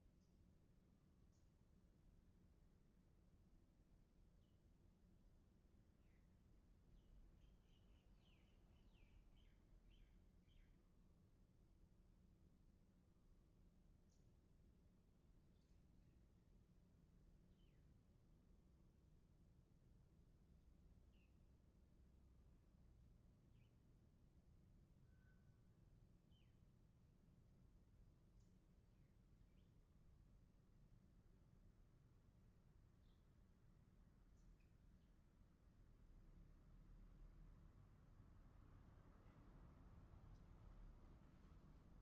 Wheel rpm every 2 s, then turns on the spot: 0, 0, 0, 0, 0, 0, 0, 0, 0, 0, 0, 0, 0, 0, 0, 0, 0, 0, 0, 0, 0.
none